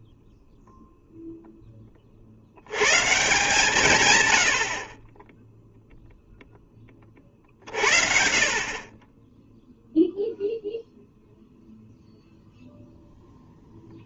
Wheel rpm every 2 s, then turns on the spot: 0, 100, 60, 10, 60, 0, 0.
none